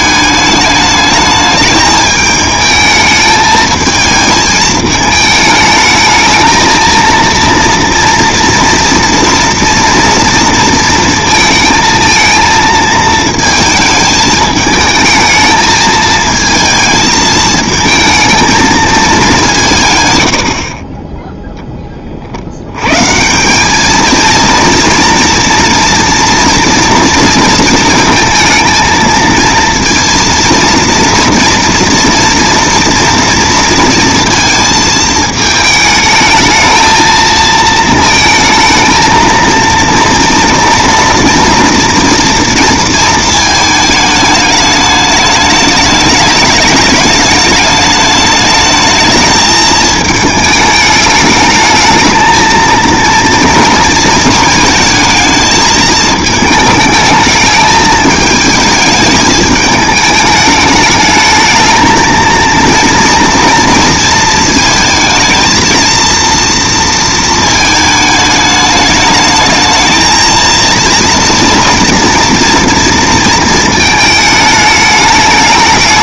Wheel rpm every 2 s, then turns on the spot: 210, 210, 220, 220, 230, 230, 220, 220, 220, 220, 50, 90, 230, 230, 230, 230, 230, 230, 220, 220, 230, 230, 210, 210, 210, 210, 230, 220, 220, 220, 210, 230, 230, 230, 210, 230, 230, 210.
none